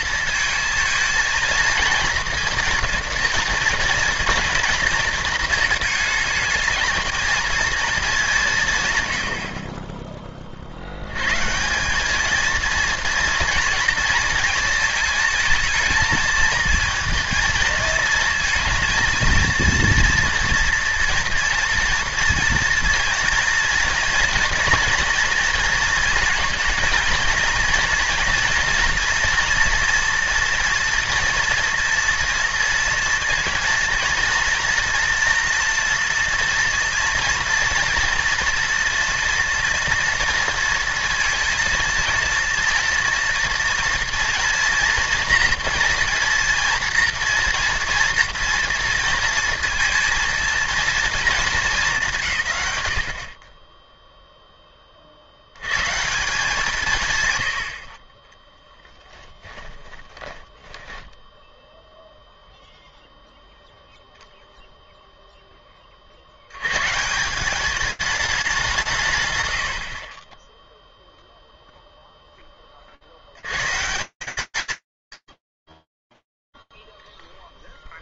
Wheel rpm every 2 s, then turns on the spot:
220, 230, 230, 220, 160, 50, 220, 230, 220, 230, 230, 230, 230, 220, 230, 230, 230, 230, 240, 230, 230, 230, 230, 240, 230, 230, 130, 20, 180, 20, 10, 0, 10, 170, 150, 0, 110, 40, 0.
58-62